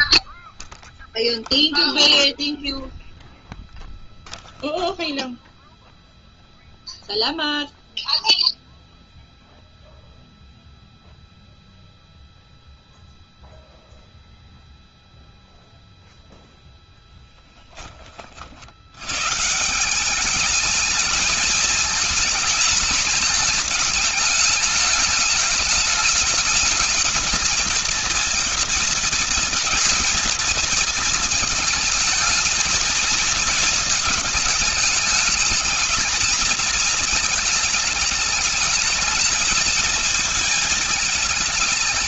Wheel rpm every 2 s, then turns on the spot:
0, 0, 0, 0, 0, 0, 0, 0, 10, 140, 220, 220, 210, 230, 230, 220, 220, 220, 220, 220, 220.
none